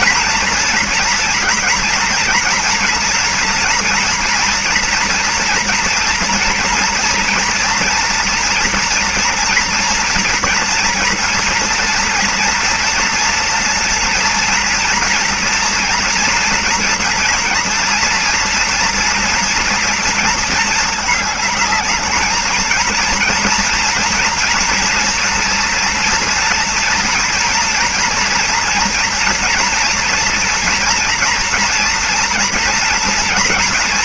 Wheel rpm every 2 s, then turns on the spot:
240, 240, 240, 230, 240, 240, 230, 230, 230, 230, 220, 220, 230, 240, 230, 230, 230.
none